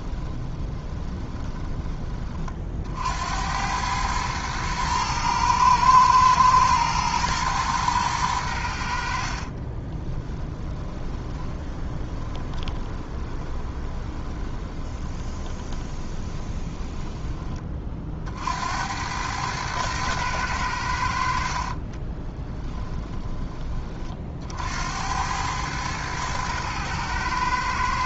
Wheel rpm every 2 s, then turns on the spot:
20, 60, 110, 110, 70, 20, 20, 20, 20, 80, 80, 10, 70, 110.
0-2 10-18 22-24